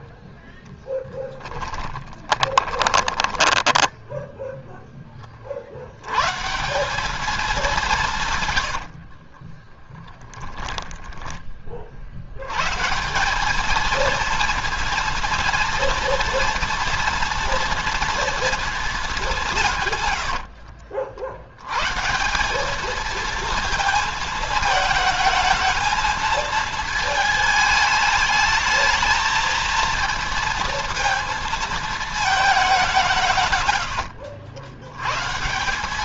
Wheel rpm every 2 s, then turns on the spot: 30, 20, 30, 200, 30, 30, 200, 230, 230, 170, 70, 230, 220, 220, 230, 230, 140, 130.
0-4 8-10